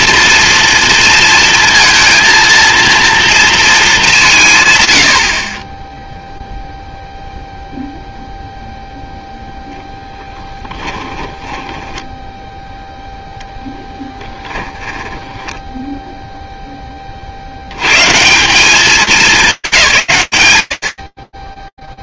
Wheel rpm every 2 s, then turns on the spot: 230, 230, 120, 0, 0, 10, 0, 10, 60, 210, 30.
10-12 14-16